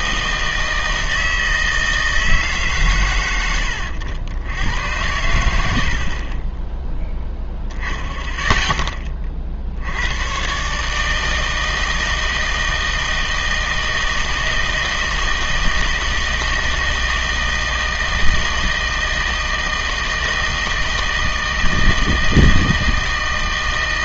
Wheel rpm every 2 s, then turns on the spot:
160, 130, 90, 10, 10, 140, 160, 160, 160, 160, 160, 160.
none